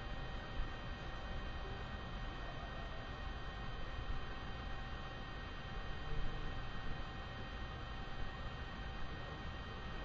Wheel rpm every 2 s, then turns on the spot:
0, 0, 0, 0, 0.
none